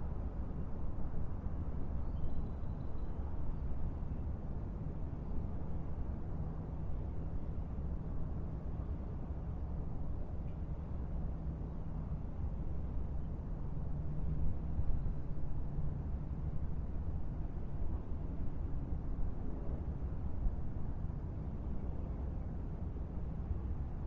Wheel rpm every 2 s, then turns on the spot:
0, 0, 0, 0, 0, 0, 0, 0, 0, 0, 0, 0.
none